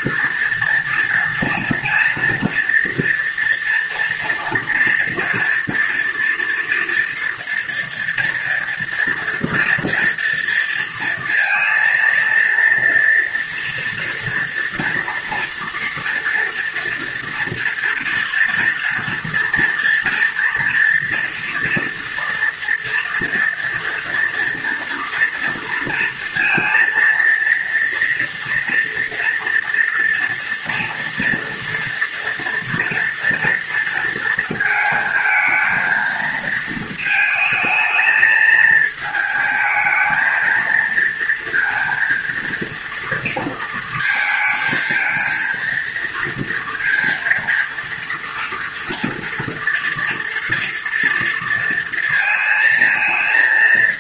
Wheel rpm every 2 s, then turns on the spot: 230, 230, 230, 230, 240, 230, 230, 230, 230, 230, 230, 230, 230, 230, 230, 230, 230, 230, 220, 220, 220, 230, 230, 230, 230, 230, 230.
none